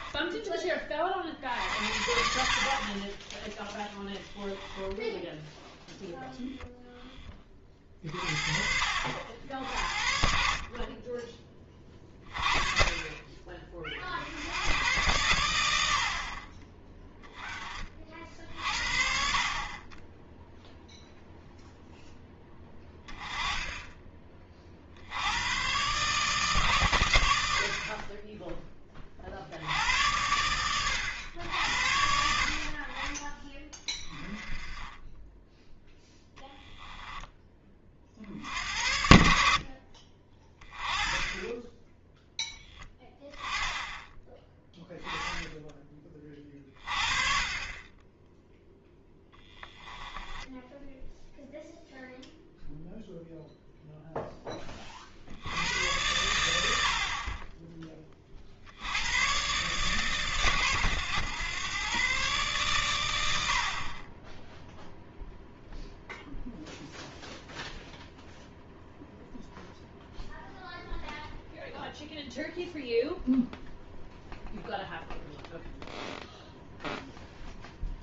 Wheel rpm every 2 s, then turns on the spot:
30, 40, 10, 10, 50, 30, 30, 100, 20, 50, 0, 20, 50, 120, 20, 100, 40, 20, 10, 70, 20, 10, 10, 30, 0, 10, 0, 30, 70, 80, 120, 120, 0, 0, 0, 0, 0, 0, 0.
50-52